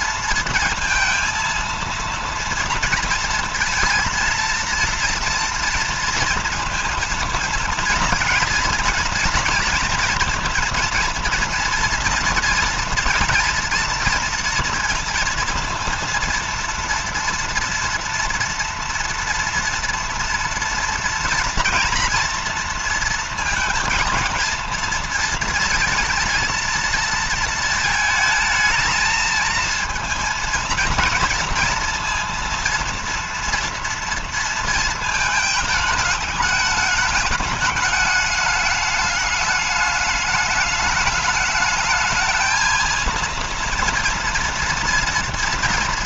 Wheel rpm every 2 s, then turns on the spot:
230, 230, 230, 230, 230, 230, 240, 230, 230, 230, 230, 230, 220, 230, 220, 230, 230, 230, 210, 210, 210, 220, 230.
none